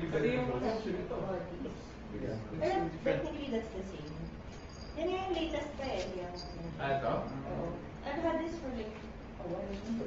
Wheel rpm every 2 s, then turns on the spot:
0, 0, 0, 0, 0.
none